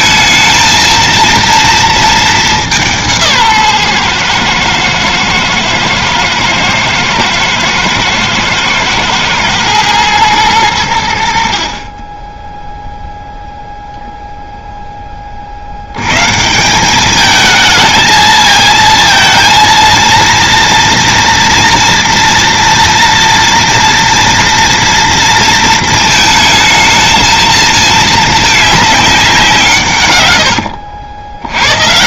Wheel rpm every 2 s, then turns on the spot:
220, 190, 120, 110, 110, 110, 10, 0, 170, 220, 230, 230, 230, 220, 210, 90.
30-32